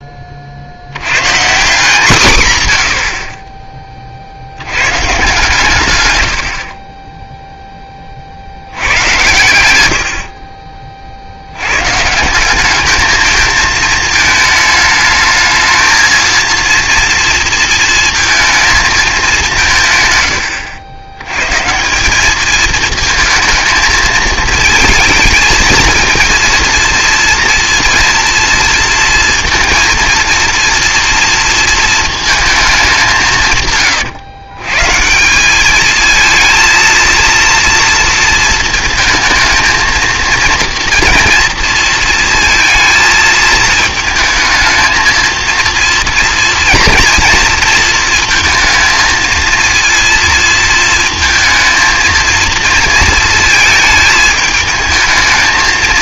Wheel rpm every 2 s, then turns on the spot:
140, 70, 130, 20, 90, 40, 210, 220, 230, 230, 90, 220, 220, 230, 230, 230, 210, 130, 230, 230, 230, 230, 220, 240, 220, 230, 230, 220.
none